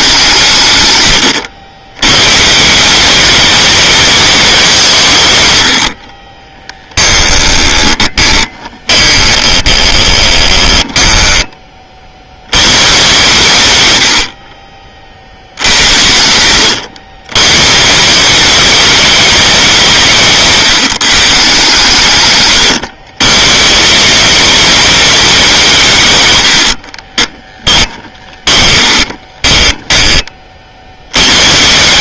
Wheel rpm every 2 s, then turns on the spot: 140, 140, 190, 30, 20, 10, 100, 50, 100, 190, 150, 120, 210, 80, 20, 40.
6-12 22-24 26-30